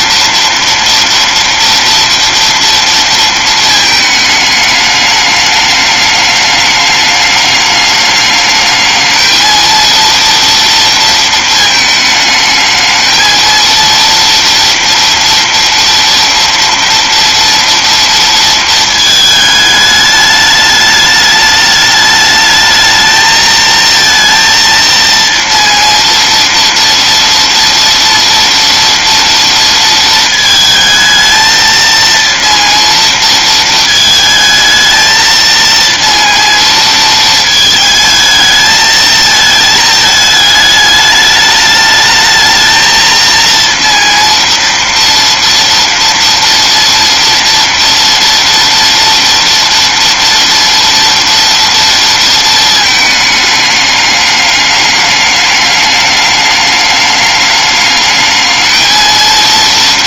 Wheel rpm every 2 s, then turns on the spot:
230, 230, 210, 210, 220, 230, 220, 230, 230, 220, 210, 220, 230, 230, 230, 220, 230, 220, 220, 220, 210, 230, 230, 230, 230, 230, 210, 210, 210, 230.
none